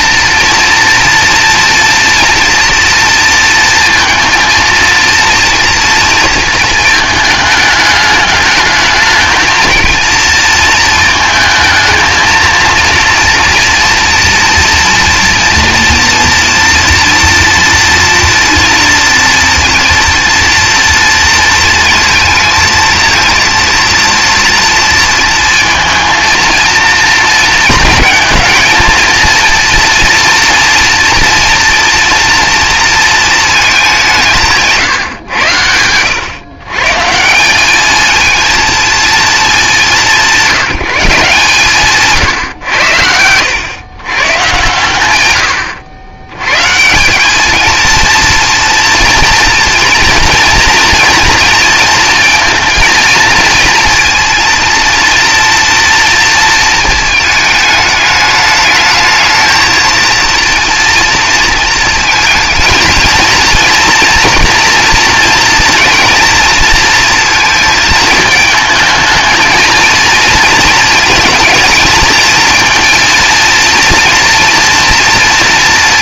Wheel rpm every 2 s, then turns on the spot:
230, 230, 230, 220, 220, 230, 230, 230, 230, 230, 230, 230, 230, 230, 230, 230, 230, 140, 150, 220, 170, 100, 100, 150, 230, 230, 230, 230, 230, 220, 230, 220, 230, 230, 220, 230, 230, 240.
none